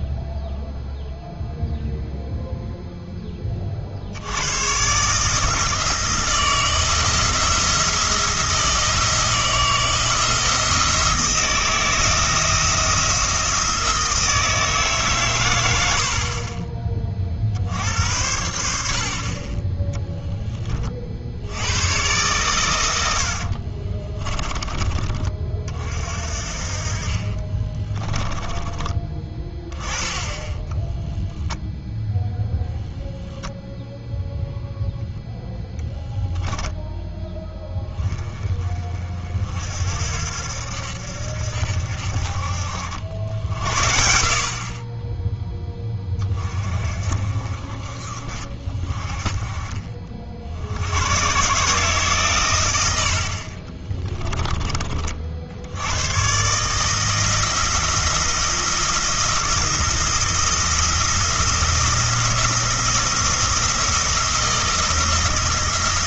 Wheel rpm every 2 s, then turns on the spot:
0, 0, 120, 170, 170, 170, 170, 150, 30, 70, 30, 110, 30, 50, 20, 10, 0, 0, 10, 30, 70, 60, 40, 30, 30, 70, 90, 20, 150, 170, 170, 170, 170.
28-32 36-38